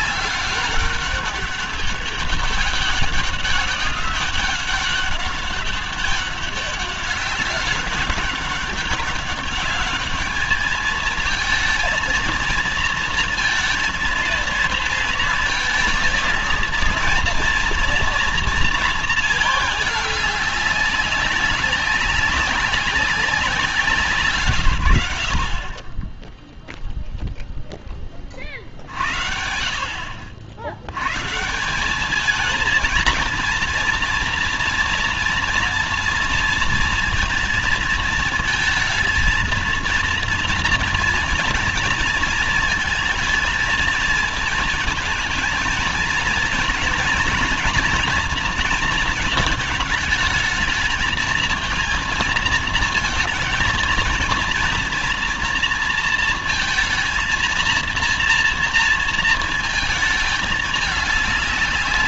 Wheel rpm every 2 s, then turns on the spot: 200, 200, 200, 190, 200, 220, 230, 230, 230, 230, 200, 190, 130, 0, 40, 80, 220, 230, 230, 230, 230, 220, 220, 220, 230, 220, 230, 230, 230, 230, 210.
none